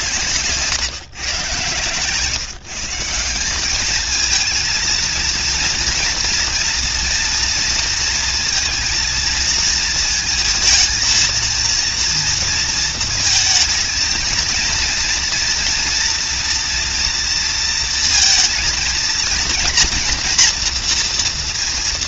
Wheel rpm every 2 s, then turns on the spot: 140, 170, 230, 230, 230, 230, 230, 230, 230, 230, 240.
none